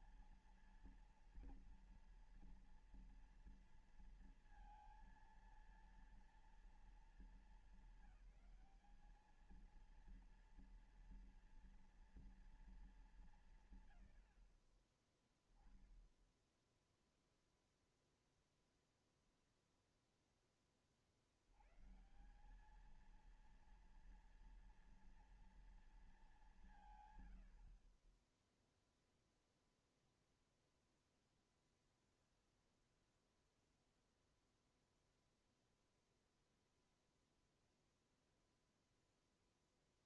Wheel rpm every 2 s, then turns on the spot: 230, 230, 230, 230, 220, 230, 230, 110, 0, 0, 0, 140, 230, 220, 40, 0, 0, 0, 0, 0.
none